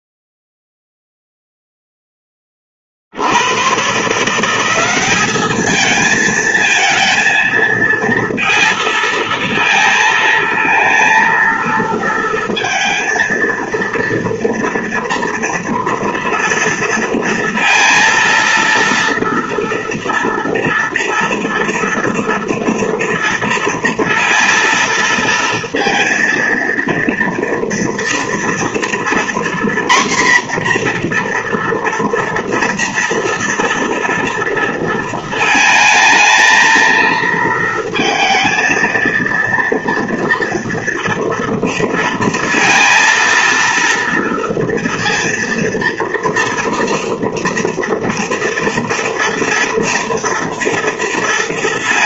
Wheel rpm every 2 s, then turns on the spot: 0, 50, 190, 220, 230, 230, 230, 230, 230, 230, 230, 230, 230, 230, 240, 250, 230, 230, 230, 230, 230, 230, 230, 230, 230, 230.
none